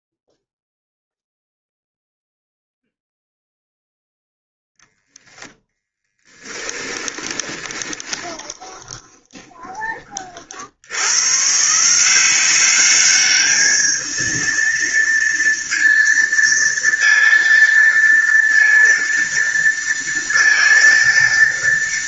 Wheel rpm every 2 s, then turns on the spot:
0, 0, 0, 10, 20, 80, 200, 230, 230, 230, 230.
6-10